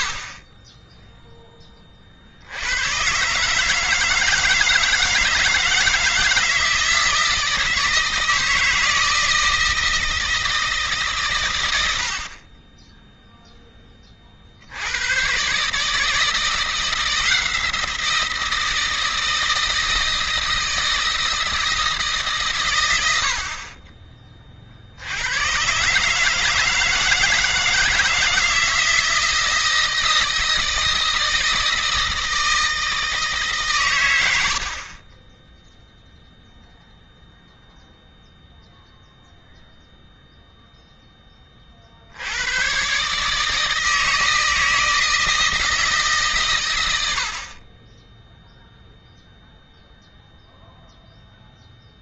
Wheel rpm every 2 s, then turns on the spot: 30, 90, 170, 160, 160, 160, 30, 70, 170, 160, 160, 120, 50, 160, 160, 160, 160, 60, 0, 0, 0, 110, 160, 120, 0, 0.
none